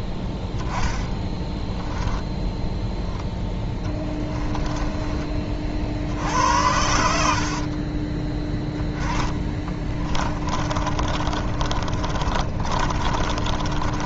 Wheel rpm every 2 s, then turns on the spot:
10, 0, 20, 70, 20, 30, 30.
0-2 4-6 8-14